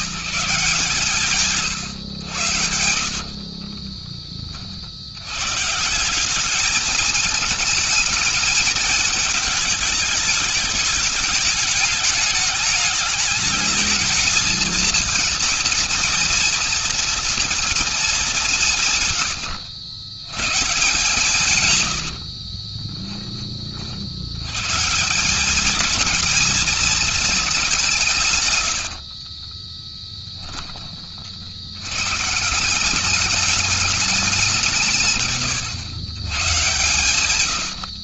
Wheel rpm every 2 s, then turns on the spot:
180, 90, 30, 180, 210, 210, 210, 220, 230, 210, 120, 80, 90, 220, 130, 10, 160, 190, 130.
22-24